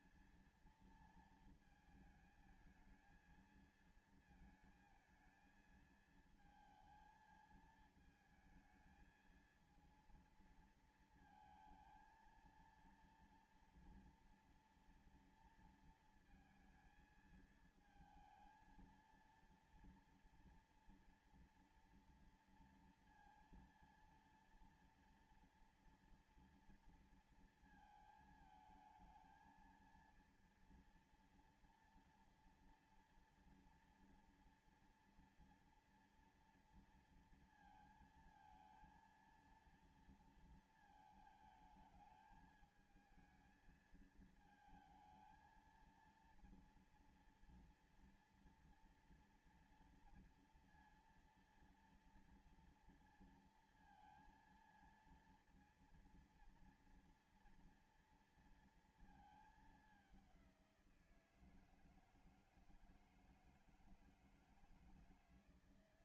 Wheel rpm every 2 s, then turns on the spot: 230, 220, 220, 220, 220, 230, 230, 230, 220, 230, 230, 230, 230, 230, 220, 230, 240, 230, 230, 230, 230, 220, 220, 230, 230, 230, 230, 230, 230, 230, 180, 160, 160.
none